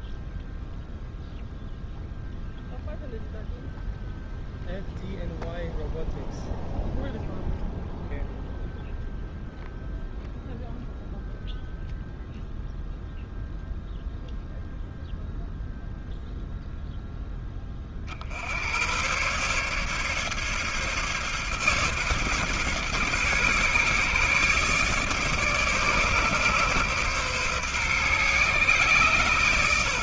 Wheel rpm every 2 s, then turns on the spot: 0, 0, 0, 0, 0, 0, 0, 0, 0, 70, 140, 140, 140, 140, 130.
none